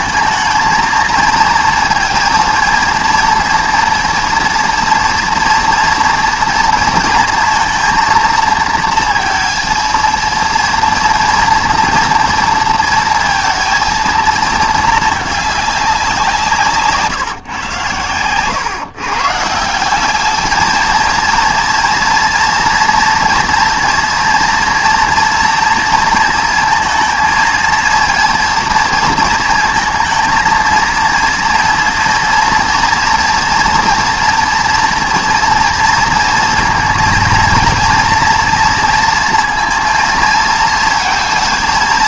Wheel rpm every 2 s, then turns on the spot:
220, 230, 230, 230, 230, 230, 220, 220, 150, 130, 220, 230, 240, 230, 230, 230, 230, 230, 230, 230, 230.
none